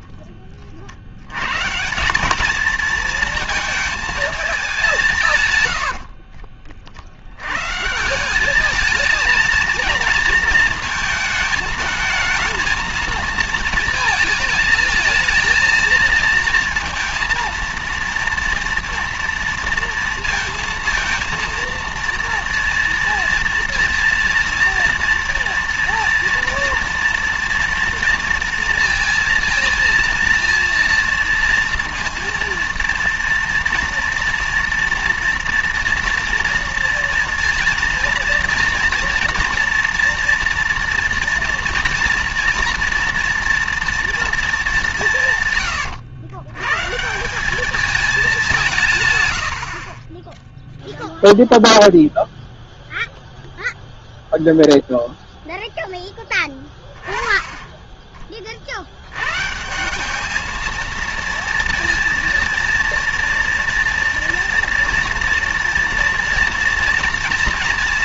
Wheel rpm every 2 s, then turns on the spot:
110, 230, 130, 100, 220, 220, 220, 220, 230, 230, 230, 230, 230, 230, 230, 230, 240, 230, 230, 230, 230, 230, 160, 150, 140, 0, 0, 0, 10, 70, 230, 230, 240, 230.
none